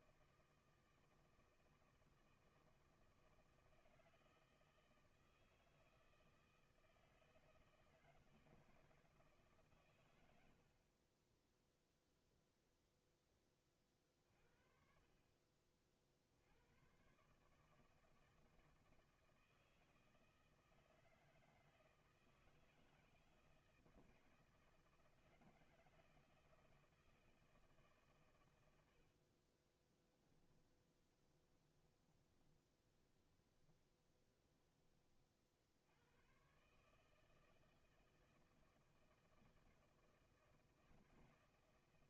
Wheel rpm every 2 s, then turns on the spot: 160, 160, 160, 160, 160, 50, 0, 40, 100, 160, 160, 160, 160, 160, 90, 10, 10, 20, 140, 160, 160.
30-34